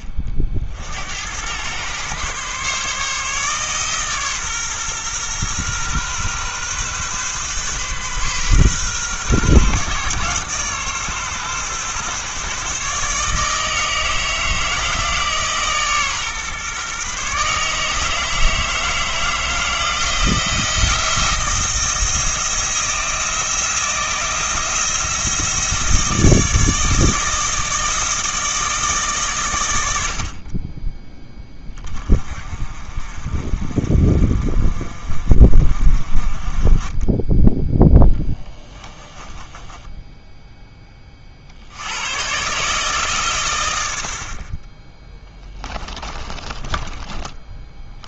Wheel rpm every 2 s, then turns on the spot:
50, 140, 130, 130, 130, 130, 140, 160, 130, 160, 170, 160, 170, 160, 160, 30, 40, 40, 20, 10, 10, 140, 30, 20.
38-40 46-48